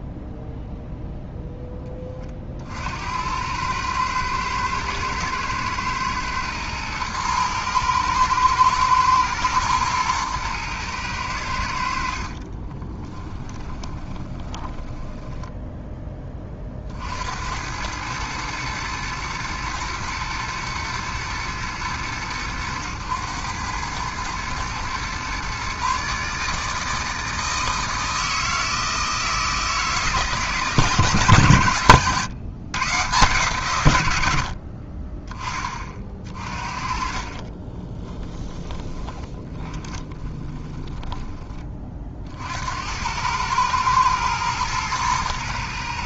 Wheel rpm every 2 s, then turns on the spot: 0, 70, 110, 120, 120, 110, 30, 20, 50, 110, 110, 110, 120, 160, 160, 150, 120, 40, 40, 20, 10, 80, 120.
12-16 36-42